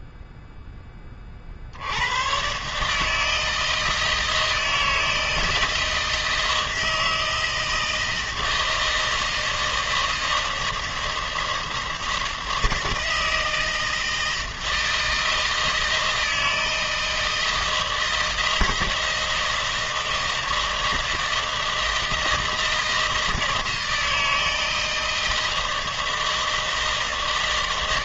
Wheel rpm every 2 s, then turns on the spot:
0, 100, 160, 160, 160, 160, 160, 160, 160, 160, 160, 160, 160, 160.
none